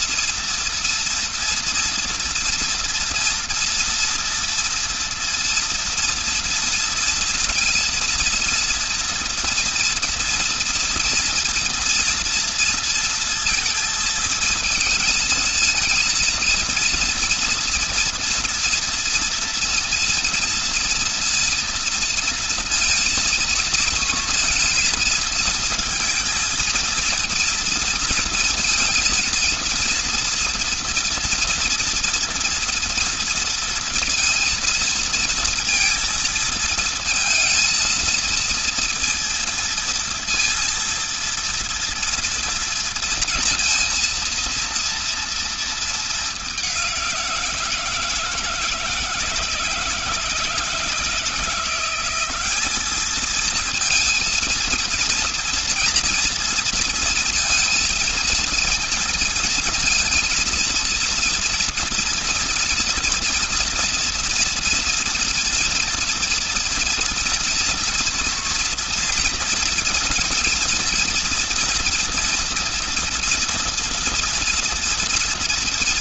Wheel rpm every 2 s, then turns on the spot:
230, 230, 230, 230, 230, 230, 230, 230, 230, 230, 230, 230, 230, 220, 230, 230, 230, 230, 230, 230, 230, 230, 230, 210, 170, 170, 190, 230, 230, 230, 230, 230, 230, 230, 230, 230, 230, 230.
none